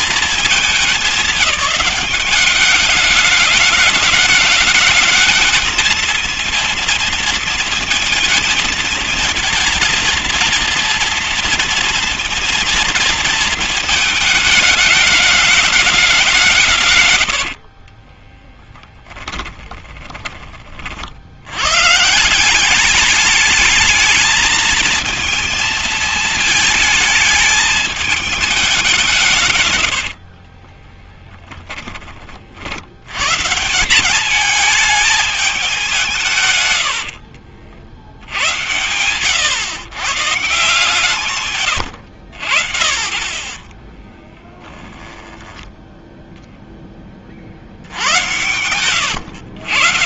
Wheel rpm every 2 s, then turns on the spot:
210, 200, 220, 230, 220, 230, 230, 210, 160, 10, 30, 190, 230, 220, 190, 30, 70, 210, 120, 100, 150, 60, 10, 20, 100.
18-20 30-32 36-38 48-50